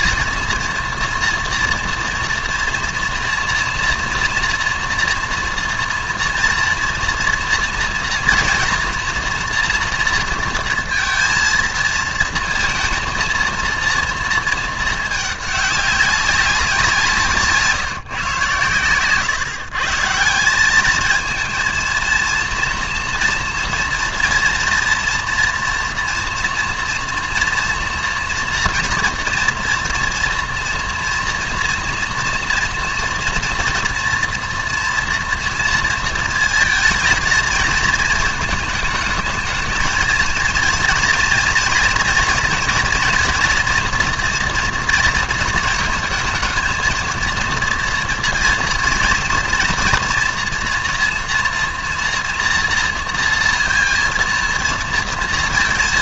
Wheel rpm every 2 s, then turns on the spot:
230, 240, 230, 230, 230, 230, 230, 230, 190, 120, 180, 230, 230, 230, 230, 230, 230, 230, 220, 220, 230, 230, 230, 220, 230, 240, 230, 230.
none